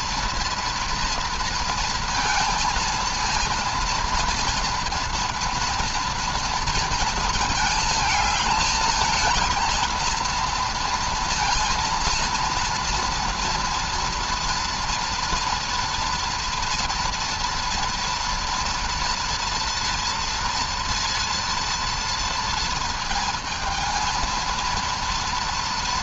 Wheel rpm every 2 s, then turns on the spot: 230, 230, 230, 230, 220, 230, 230, 230, 230, 230, 230, 230, 230.
none